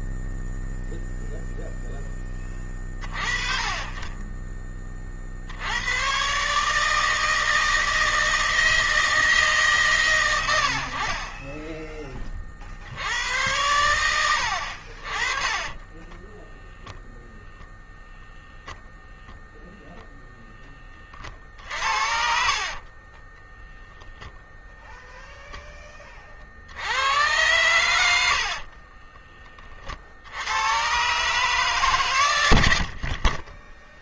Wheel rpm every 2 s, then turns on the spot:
0, 40, 30, 150, 160, 60, 70, 40, 0, 0, 30, 30, 0, 90, 30, 120, 50.
22-24 28-30 32-34